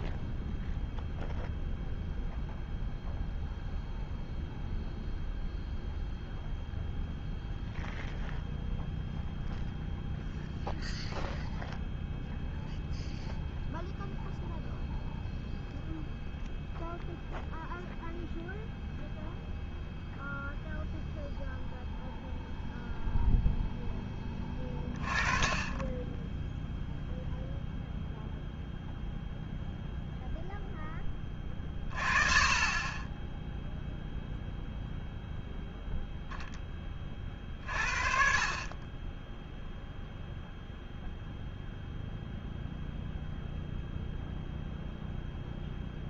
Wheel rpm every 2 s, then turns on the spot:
0, 0, 0, 0, 0, 0, 0, 0, 0, 0, 0, 0, 20, 0, 0, 10, 20, 0, 20, 30, 0, 0, 0.
none